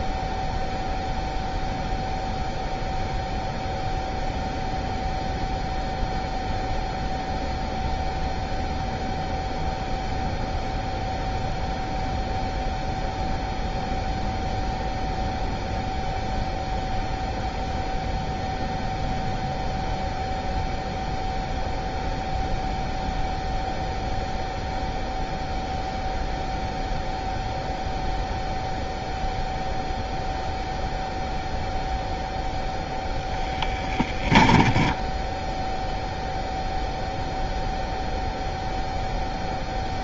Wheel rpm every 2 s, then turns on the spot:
0, 0, 0, 0, 0, 0, 0, 0, 0, 0, 0, 0, 0, 0, 0, 0, 0, 10, 0, 0.
34-36